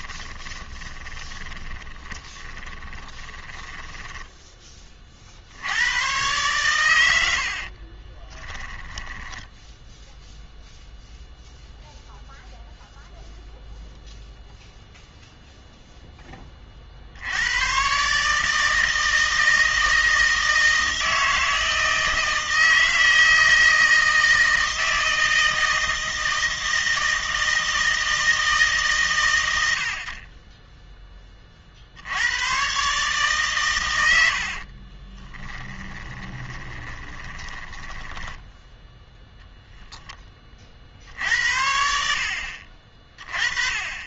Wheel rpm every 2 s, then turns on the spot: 20, 20, 20, 120, 20, 0, 0, 0, 30, 160, 160, 160, 160, 160, 150, 20, 120, 60, 20, 10, 30, 50.
0-4 8-10 34-38